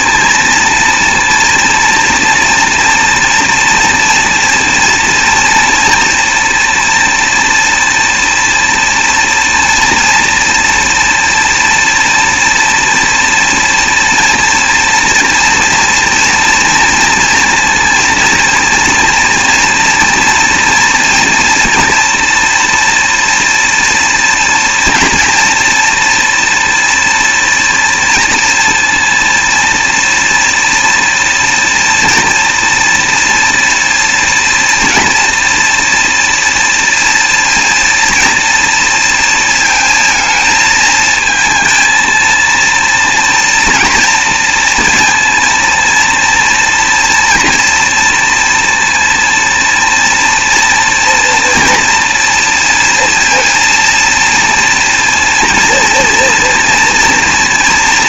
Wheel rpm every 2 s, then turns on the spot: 230, 230, 230, 230, 230, 230, 230, 230, 230, 230, 230, 230, 240, 230, 230, 230, 230, 230, 230, 240, 220, 230, 230, 230, 230, 230, 230, 230, 230.
none